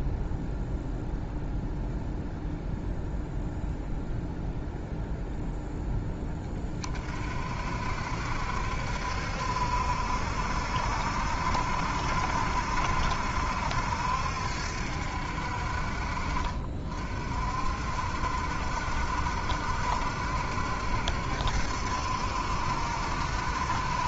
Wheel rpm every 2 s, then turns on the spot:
0, 0, 0, 30, 60, 70, 70, 70, 50, 70, 70, 70.
none